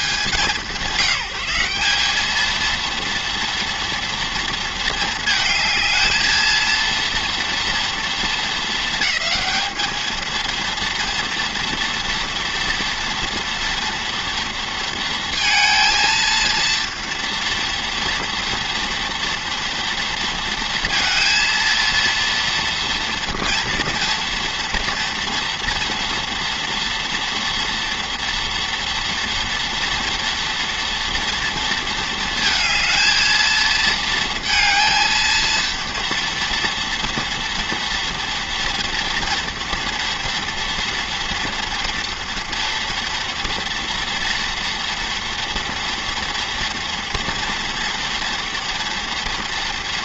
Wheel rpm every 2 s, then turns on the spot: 170, 230, 230, 230, 220, 230, 230, 230, 230, 240, 230, 230, 230, 230, 240, 230, 220, 230, 230, 230, 230, 230, 230, 230, 240.
none